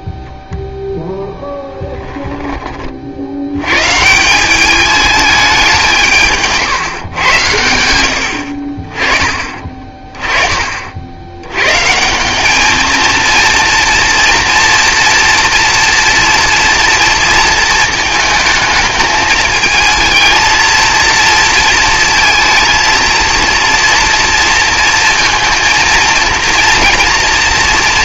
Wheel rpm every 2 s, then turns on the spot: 0, 20, 210, 140, 40, 40, 220, 230, 230, 220, 230, 230, 230, 230.
none